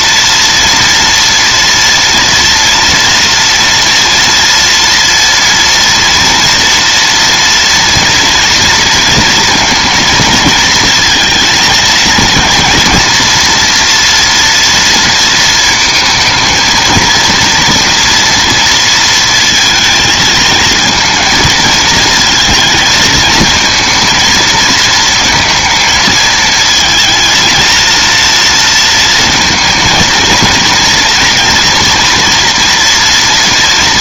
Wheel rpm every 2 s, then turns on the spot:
230, 230, 230, 230, 230, 230, 230, 230, 230, 230, 230, 220, 220, 230, 230, 230, 230.
none